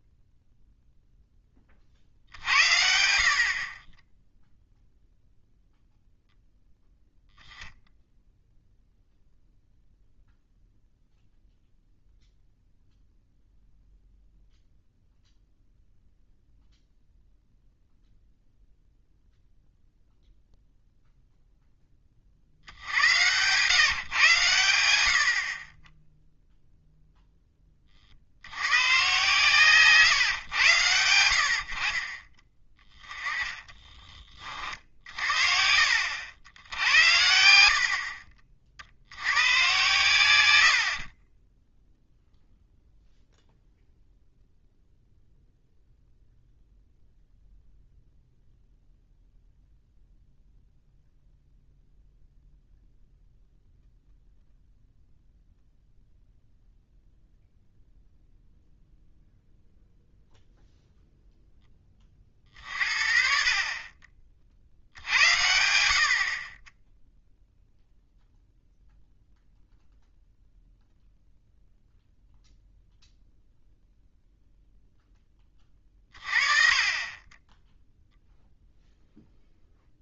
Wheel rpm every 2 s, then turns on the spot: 0, 80, 0, 0, 0, 0, 0, 0, 0, 0, 0, 70, 110, 0, 100, 110, 20, 50, 90, 50, 80, 0, 0, 0, 0, 0, 0, 0, 0, 0, 0, 40, 60, 20, 0, 0, 0, 0, 30, 0.
32-36